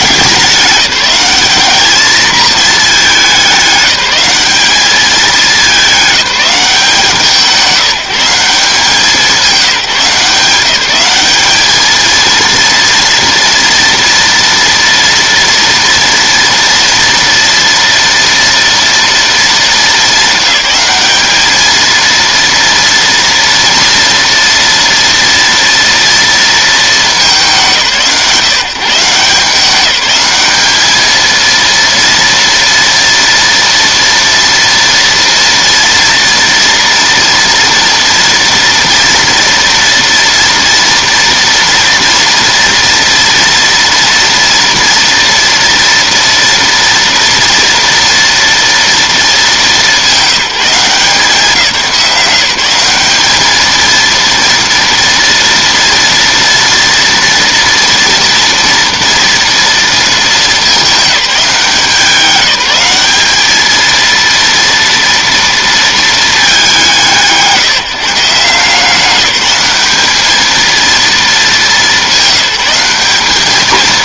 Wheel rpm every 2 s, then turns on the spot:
200, 220, 210, 180, 180, 170, 230, 230, 230, 230, 200, 230, 230, 230, 150, 210, 230, 230, 230, 230, 230, 230, 240, 230, 230, 190, 180, 230, 230, 230, 210, 190, 230, 190, 170, 220, 190.
none